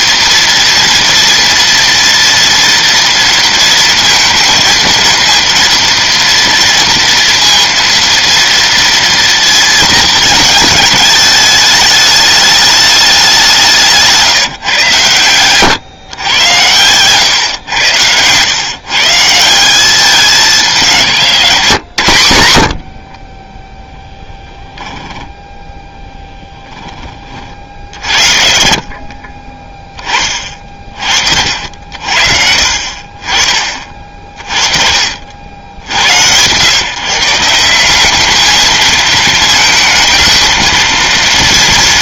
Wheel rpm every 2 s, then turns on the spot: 230, 230, 230, 230, 230, 220, 210, 140, 110, 120, 190, 80, 10, 10, 50, 40, 60, 40, 120, 220, 220.
none